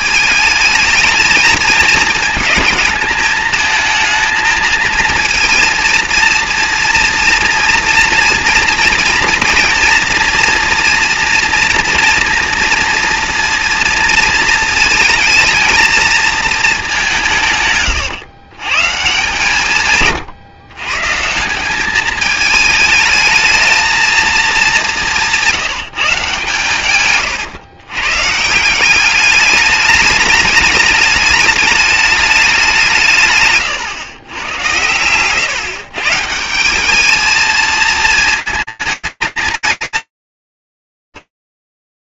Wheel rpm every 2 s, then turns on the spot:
220, 220, 230, 230, 230, 230, 220, 230, 120, 120, 210, 220, 150, 130, 210, 210, 120, 150, 220, 230, 150.
none